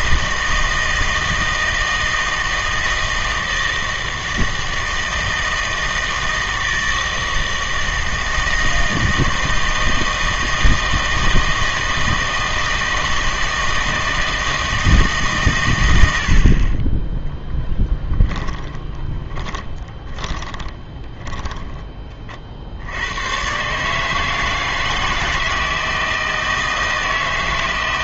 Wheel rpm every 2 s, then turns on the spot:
160, 160, 160, 160, 160, 160, 160, 160, 40, 10, 20, 70, 160, 160.
18-22